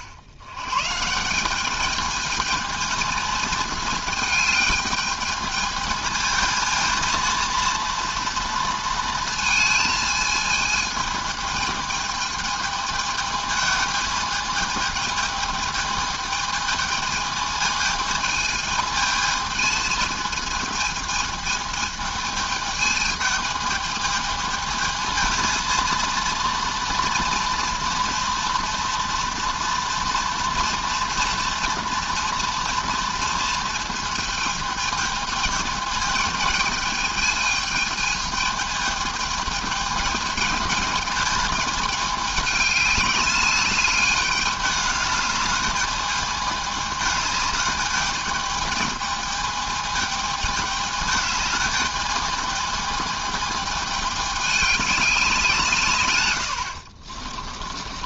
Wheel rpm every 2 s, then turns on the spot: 100, 220, 220, 220, 230, 220, 220, 220, 220, 220, 220, 220, 220, 230, 230, 230, 230, 220, 220, 220, 210, 200, 210, 210, 210, 220, 210, 200, 80.
none